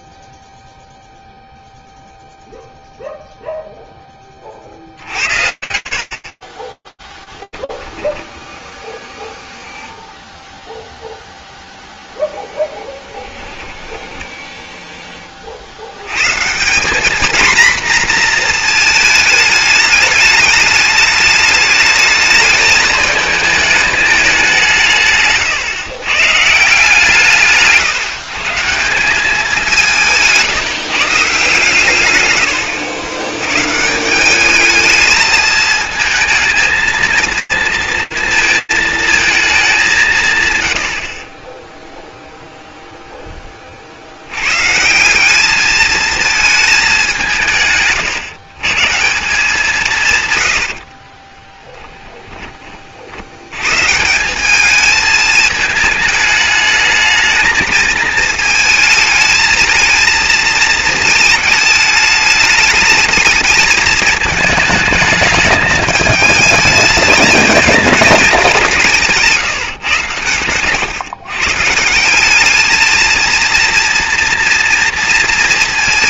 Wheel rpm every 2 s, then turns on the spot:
0, 0, 80, 10, 10, 0, 20, 30, 240, 220, 210, 220, 130, 160, 200, 160, 100, 220, 230, 220, 90, 0, 180, 190, 160, 50, 80, 220, 220, 220, 220, 220, 220, 220, 160, 140, 230, 230.
12-14 24-26 50-52